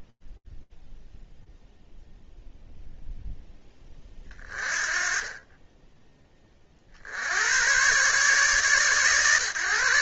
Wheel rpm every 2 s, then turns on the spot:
0, 0, 30, 80, 130.
4-6